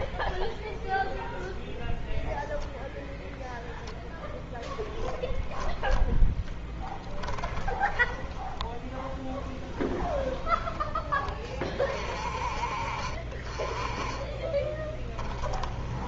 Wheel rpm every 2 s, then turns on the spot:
0, 0, 0, 10, 0, 10, 40, 10.
6-8 14-16